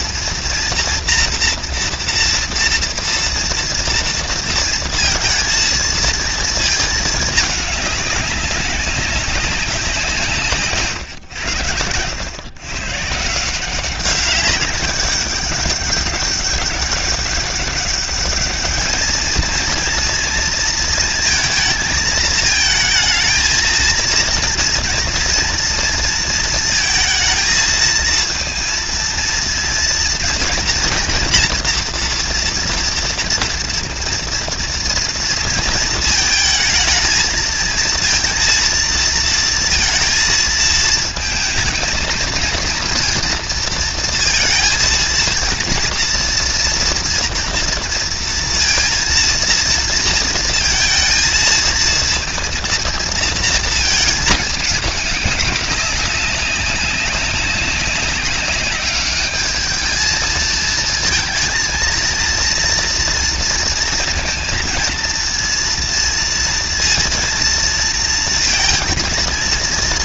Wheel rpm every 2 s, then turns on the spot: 230, 230, 230, 230, 210, 190, 100, 170, 200, 200, 230, 230, 220, 230, 220, 230, 230, 230, 230, 220, 230, 230, 230, 230, 240, 230, 230, 230, 200, 200, 210, 220, 230, 230, 230.
none